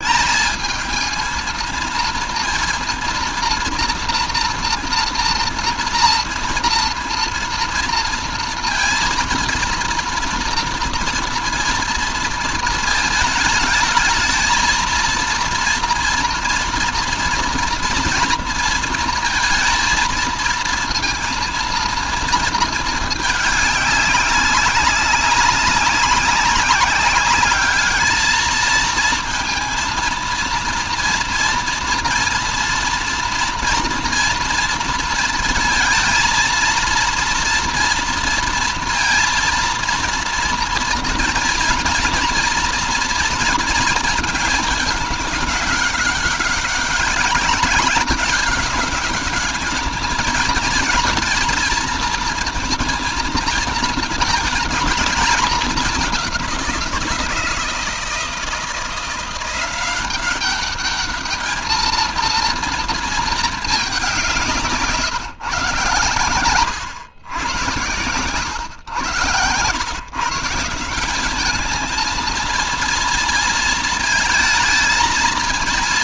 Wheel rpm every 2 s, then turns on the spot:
220, 230, 230, 230, 230, 230, 220, 230, 230, 230, 230, 220, 200, 190, 220, 230, 230, 230, 230, 230, 230, 230, 210, 200, 200, 220, 230, 220, 180, 170, 200, 230, 180, 120, 120, 170, 230, 230.
none